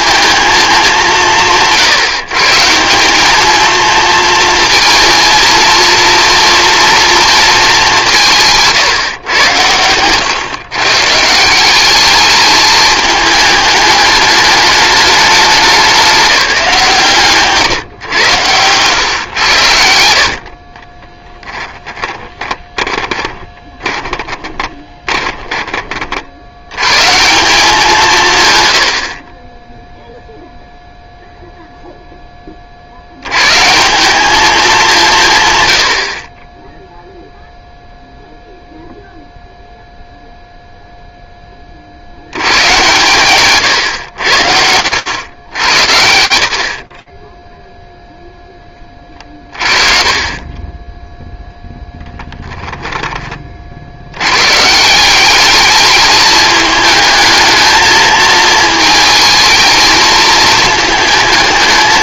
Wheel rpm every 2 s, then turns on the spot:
210, 160, 230, 230, 160, 130, 220, 210, 170, 110, 30, 20, 20, 100, 100, 0, 40, 190, 10, 0, 0, 110, 90, 30, 20, 10, 10, 170, 210, 220, 220.
20-26 46-48 50-52